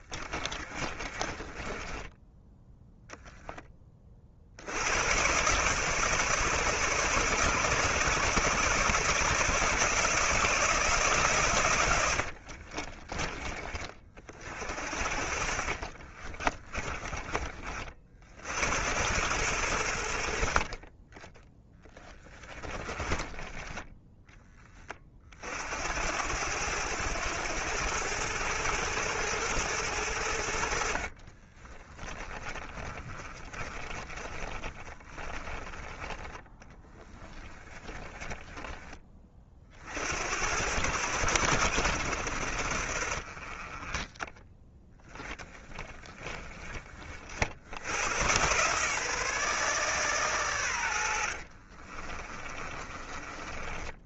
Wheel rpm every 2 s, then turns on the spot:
40, 10, 80, 140, 150, 150, 50, 50, 30, 80, 40, 20, 20, 100, 110, 70, 30, 20, 20, 20, 100, 60, 10, 20, 130, 100, 30.
0-2 12-14 16-18 20-24 32-40 52-54